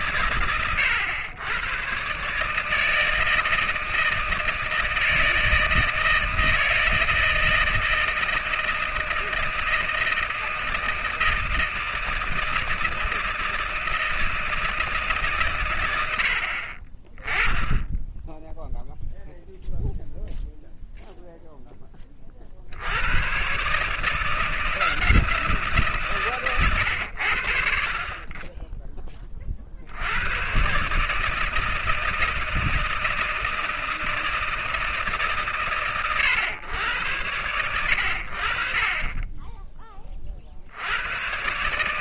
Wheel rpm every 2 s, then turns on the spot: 100, 160, 160, 160, 160, 160, 160, 140, 20, 0, 0, 90, 170, 90, 10, 140, 160, 150, 100, 30, 60.
none